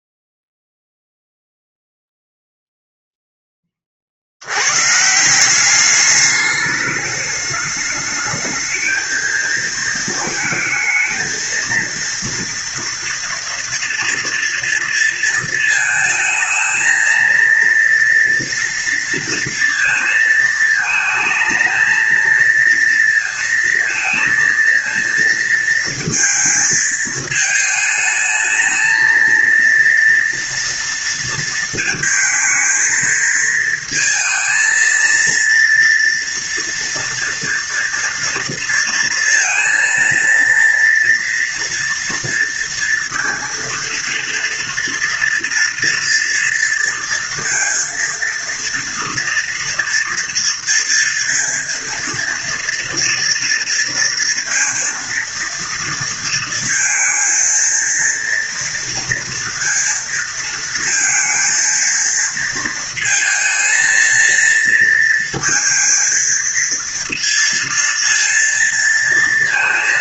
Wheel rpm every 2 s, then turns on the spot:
0, 0, 90, 210, 220, 220, 230, 230, 220, 230, 220, 230, 230, 220, 220, 230, 220, 220, 230, 230, 230, 230, 230, 230, 230, 230, 230, 230, 230, 230, 230, 230, 230, 230, 230.
none